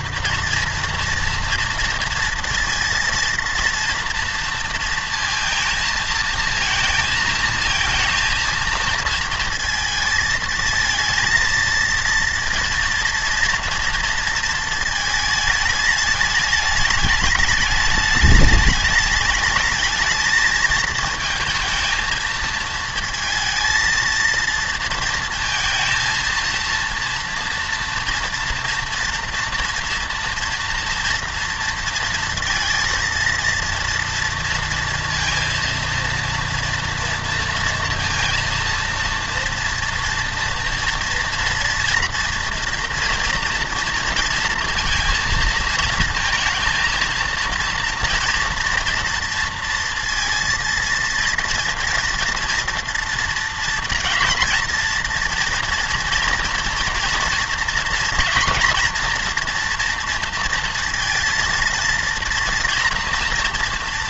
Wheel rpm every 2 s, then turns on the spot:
230, 230, 230, 230, 230, 220, 230, 230, 210, 210, 220, 230, 230, 230, 230, 230, 230, 230, 230, 230, 230, 230, 230, 230, 230, 230, 230, 230, 230, 230, 230, 230.
none